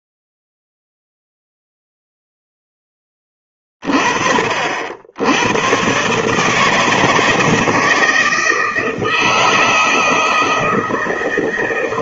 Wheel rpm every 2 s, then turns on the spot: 0, 0, 50, 150, 160, 160.
none